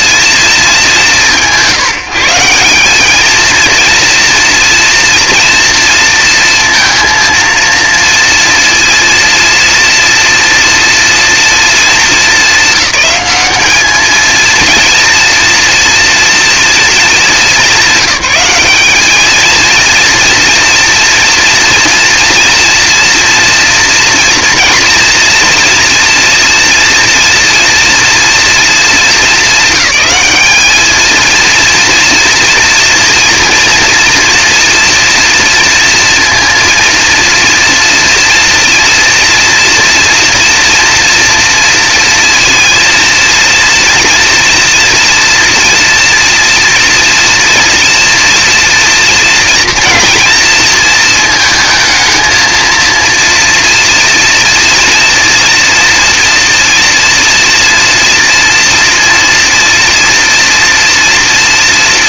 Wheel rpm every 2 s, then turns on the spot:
190, 190, 230, 230, 230, 240, 200, 230, 220, 200, 230, 230, 230, 240, 230, 220, 230, 230, 230, 230, 240, 230, 240, 230, 230, 230, 230, 230, 230, 230, 230.
none